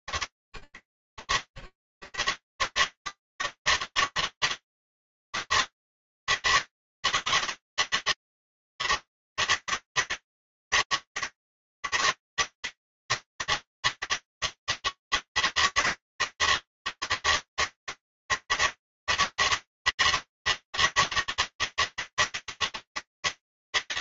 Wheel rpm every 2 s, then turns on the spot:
90, 120, 160, 160, 160, 160, 160, 160, 160, 160, 160, 160.
none